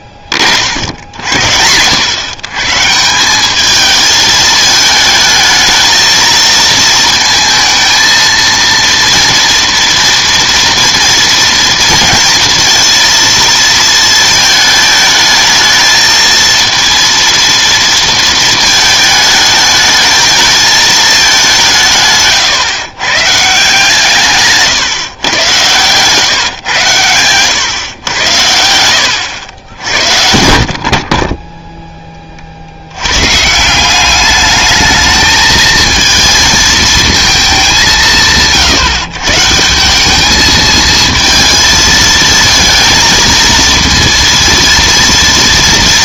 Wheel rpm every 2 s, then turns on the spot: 70, 130, 220, 220, 230, 230, 230, 220, 230, 220, 220, 140, 140, 120, 90, 60, 50, 210, 220, 160, 220, 230, 230.
none